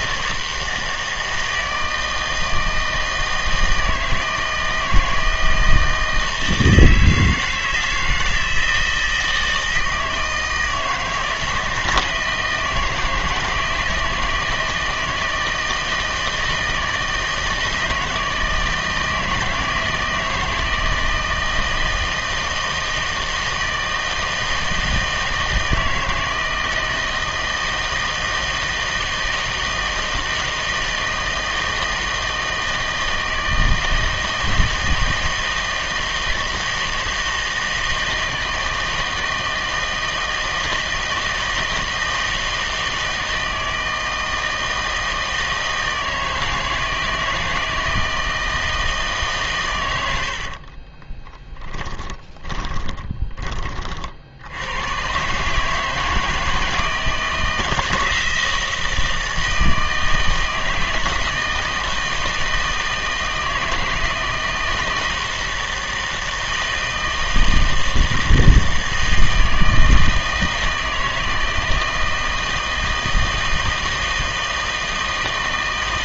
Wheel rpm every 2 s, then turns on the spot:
160, 160, 160, 160, 160, 160, 160, 160, 160, 160, 160, 160, 160, 160, 160, 160, 160, 160, 160, 160, 160, 160, 160, 160, 160, 40, 20, 100, 160, 160, 160, 160, 160, 160, 160, 160, 160, 160.
50-54